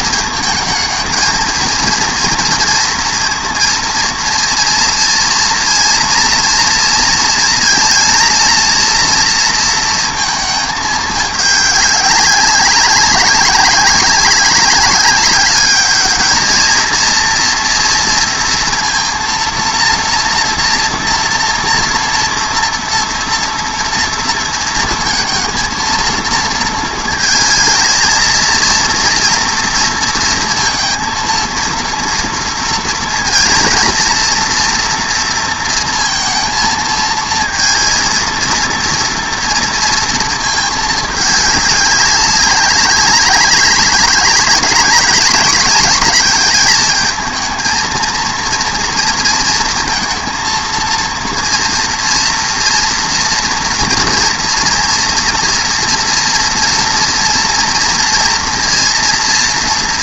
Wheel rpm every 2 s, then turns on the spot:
220, 240, 230, 230, 230, 220, 190, 190, 220, 230, 230, 230, 230, 220, 230, 230, 230, 230, 230, 230, 220, 190, 200, 220, 230, 230, 230, 230, 230, 230.
none